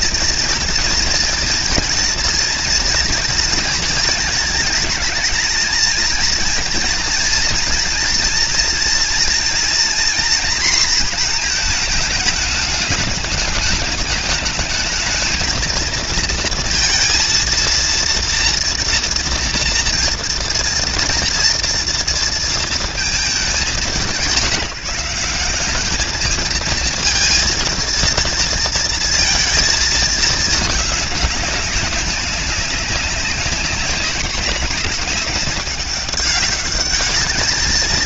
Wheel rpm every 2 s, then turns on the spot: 230, 230, 220, 230, 230, 240, 210, 220, 230, 230, 230, 230, 180, 220, 230, 210, 190, 200, 200.
none